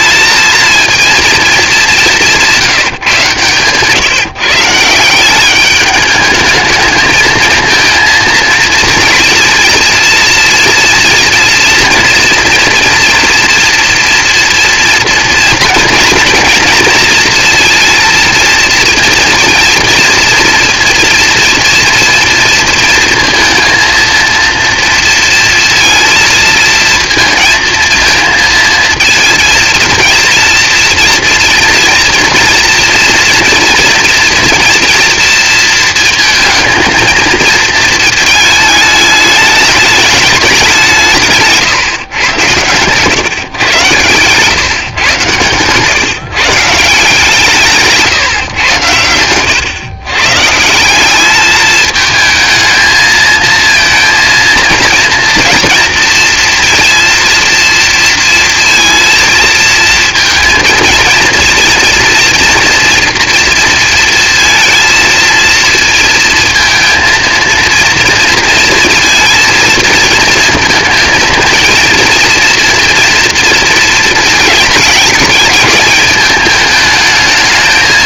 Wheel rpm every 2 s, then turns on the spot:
230, 170, 150, 220, 230, 230, 240, 230, 230, 230, 230, 230, 230, 220, 230, 230, 230, 240, 220, 220, 200, 120, 140, 150, 120, 160, 220, 230, 230, 230, 230, 230, 230, 230, 230, 230, 230, 220, 220.
2-4 42-44